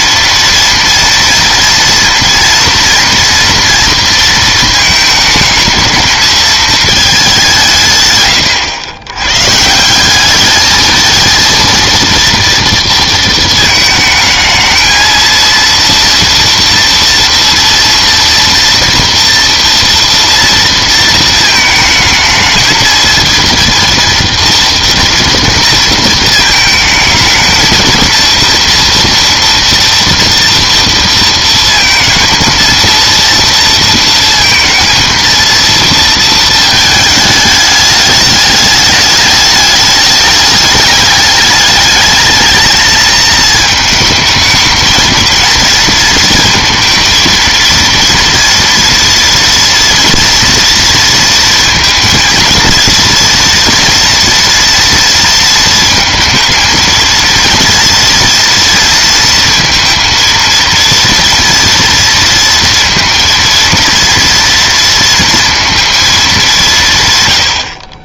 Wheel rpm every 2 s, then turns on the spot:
230, 230, 220, 220, 110, 220, 230, 220, 230, 230, 230, 220, 230, 220, 230, 230, 230, 230, 220, 210, 210, 220, 220, 230, 230, 230, 230, 230, 230, 230, 230, 230, 230, 190.
none